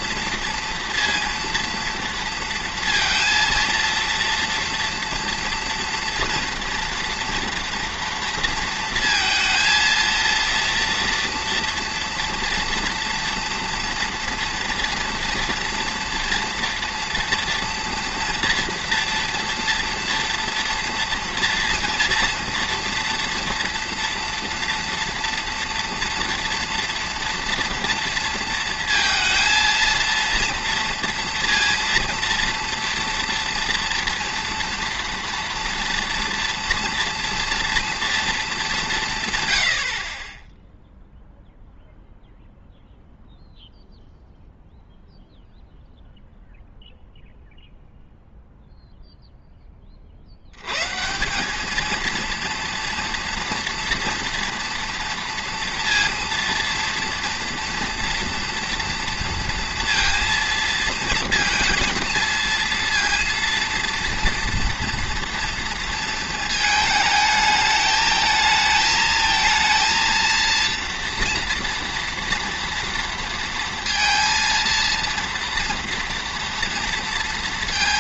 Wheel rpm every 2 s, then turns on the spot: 230, 230, 240, 230, 230, 230, 230, 230, 240, 230, 230, 240, 230, 230, 230, 230, 230, 230, 230, 210, 10, 0, 0, 0, 0, 100, 230, 240, 240, 230, 230, 230, 230, 220, 220, 230, 230, 230, 230.
none